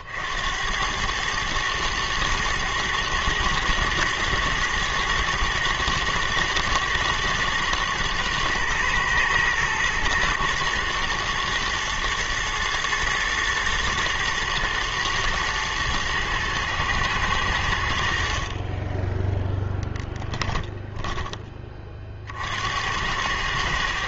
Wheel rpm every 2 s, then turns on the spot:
90, 110, 110, 120, 120, 120, 110, 110, 110, 30, 10, 70.
none